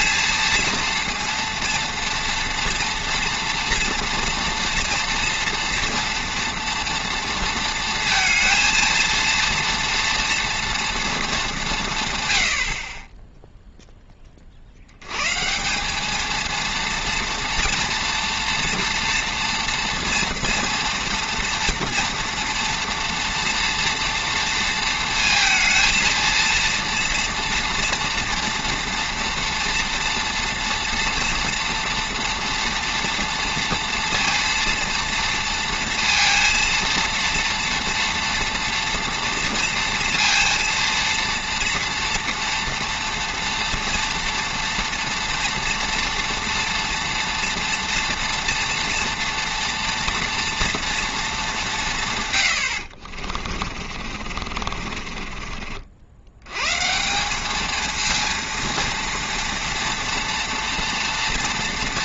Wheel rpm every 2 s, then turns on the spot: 230, 240, 230, 240, 230, 230, 80, 50, 230, 240, 230, 230, 230, 230, 230, 230, 230, 240, 230, 230, 230, 230, 230, 230, 230, 230, 70, 40, 110, 230, 230.
52-56